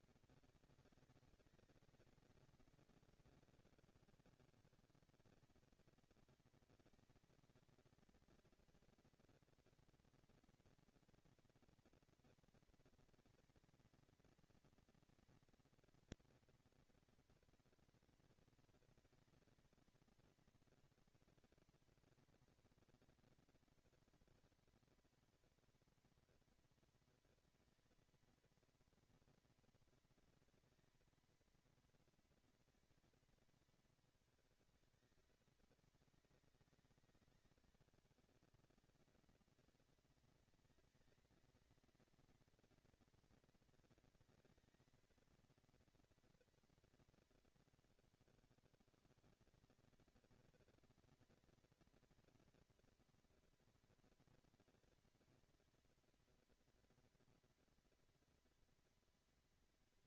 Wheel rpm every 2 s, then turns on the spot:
210, 200, 200, 220, 230, 240, 230, 230, 230, 230, 230, 230, 230, 230, 230, 230, 230, 210, 190, 210, 230, 230, 230, 230, 140, 230, 230, 230, 230, 230.
none